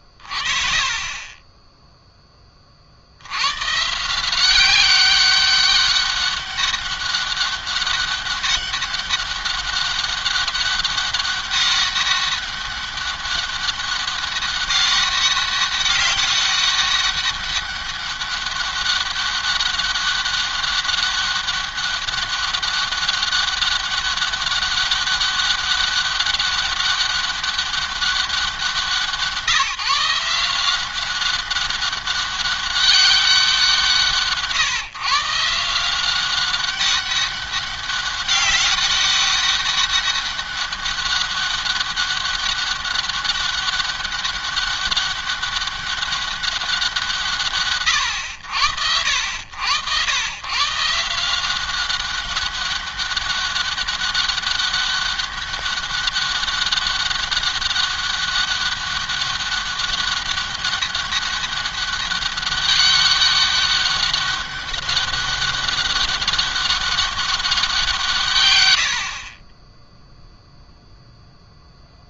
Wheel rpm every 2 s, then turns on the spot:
30, 40, 190, 200, 200, 200, 200, 200, 200, 200, 200, 200, 200, 190, 170, 180, 200, 160, 190, 200, 200, 200, 200, 170, 70, 140, 200, 200, 200, 200, 200, 200, 200, 200, 90, 0.
none